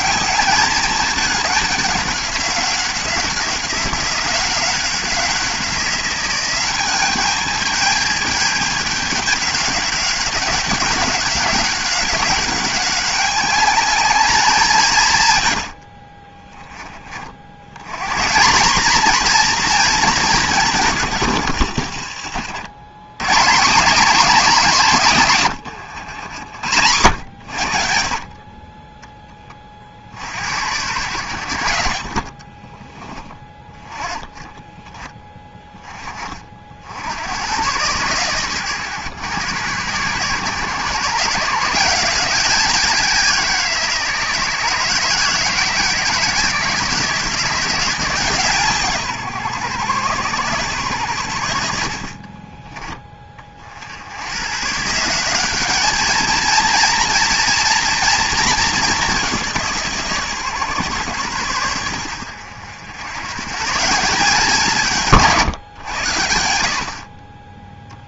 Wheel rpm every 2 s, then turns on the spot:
210, 190, 180, 190, 200, 190, 200, 180, 30, 210, 170, 120, 210, 100, 20, 90, 30, 20, 50, 120, 130, 180, 160, 160, 150, 120, 30, 130, 230, 220, 130, 90, 170, 70.
20-22 32-34 52-54